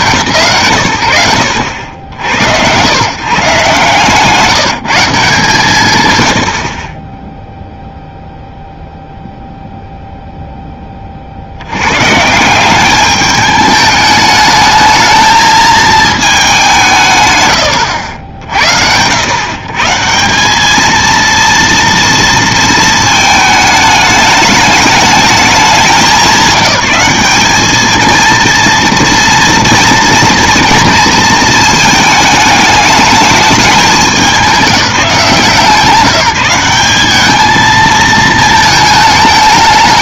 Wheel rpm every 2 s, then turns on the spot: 110, 100, 160, 100, 0, 20, 180, 210, 210, 120, 210, 220, 210, 180, 230, 240, 210, 190, 170, 220.
none